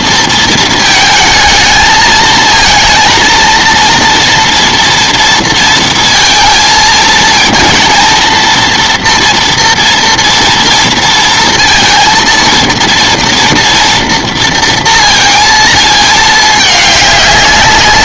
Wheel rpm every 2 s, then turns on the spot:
220, 230, 230, 230, 230, 230, 230, 230, 210.
none